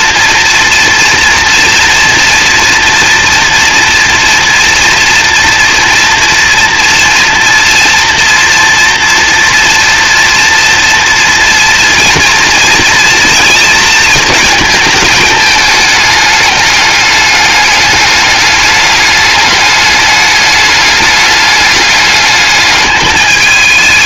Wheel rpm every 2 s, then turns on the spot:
230, 230, 230, 240, 230, 230, 230, 210, 210, 210, 210, 220.
none